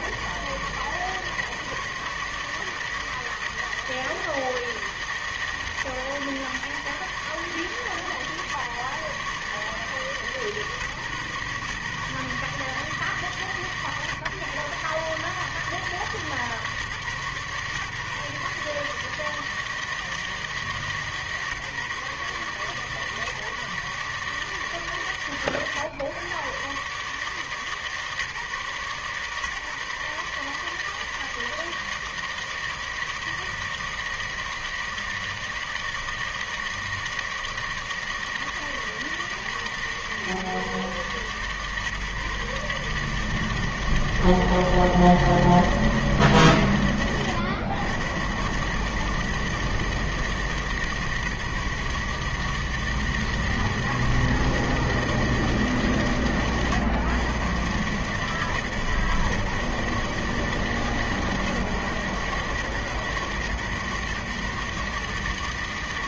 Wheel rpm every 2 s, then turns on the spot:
100, 150, 160, 140, 140, 150, 140, 130, 150, 140, 160, 150, 150, 120, 140, 140, 160, 160, 160, 160, 140, 150, 160, 140, 120, 160, 150, 160, 120, 130, 140, 130, 140.
none